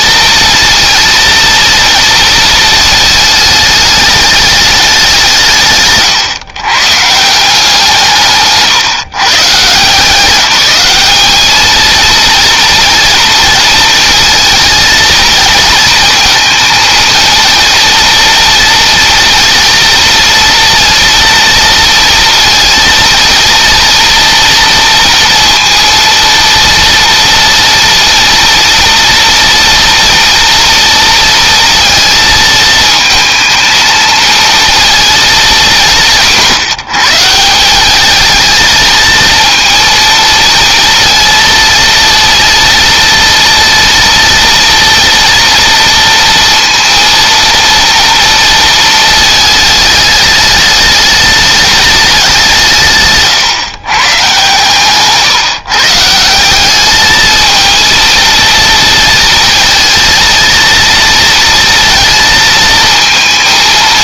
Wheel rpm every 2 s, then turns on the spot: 230, 220, 200, 130, 150, 200, 230, 230, 230, 230, 230, 230, 230, 230, 230, 230, 220, 230, 160, 220, 230, 230, 230, 230, 220, 210, 150, 140, 210, 230, 230, 220.
54-56